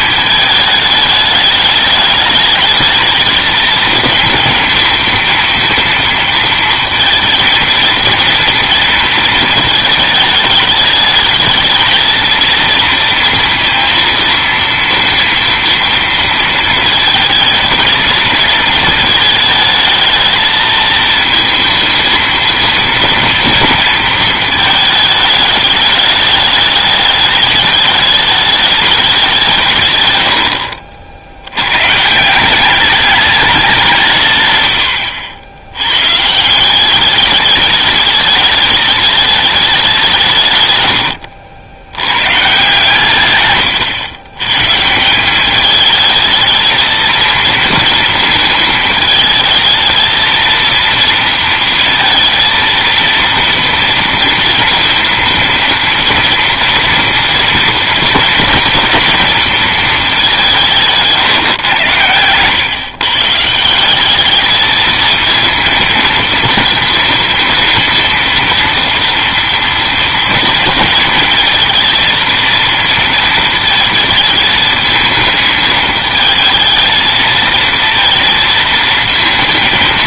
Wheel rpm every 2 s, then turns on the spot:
210, 210, 230, 230, 230, 210, 220, 230, 230, 230, 220, 230, 220, 210, 210, 60, 190, 110, 170, 210, 130, 130, 130, 220, 220, 230, 230, 230, 230, 230, 180, 120, 220, 230, 230, 220, 230, 220, 220, 220.
none